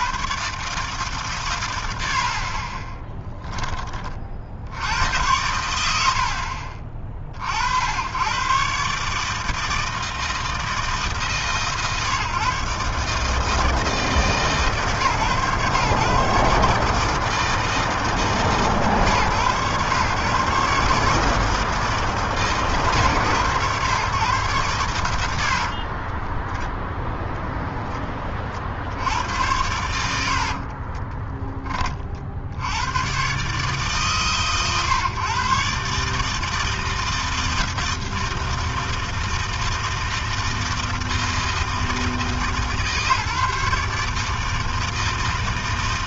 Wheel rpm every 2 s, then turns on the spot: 110, 10, 90, 60, 160, 150, 150, 130, 160, 130, 150, 120, 100, 0, 90, 20, 120, 140, 160, 160, 160, 150, 160.
24-26